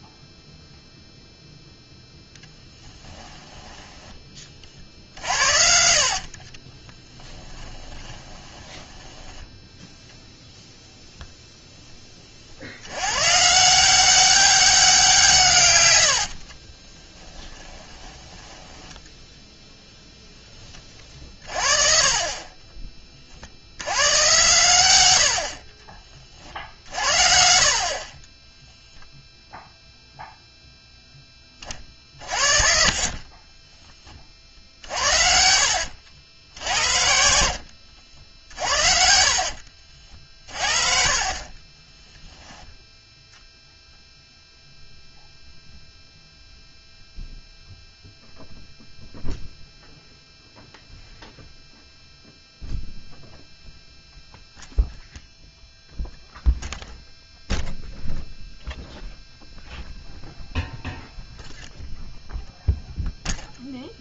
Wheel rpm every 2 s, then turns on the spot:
0, 10, 40, 30, 10, 0, 80, 190, 40, 10, 20, 30, 110, 50, 0, 0, 40, 60, 70, 50, 40, 10, 0, 0, 0, 0, 0, 0, 0, 0, 0, 0.
2-4 6-10 16-18 20-26 34-36 38-40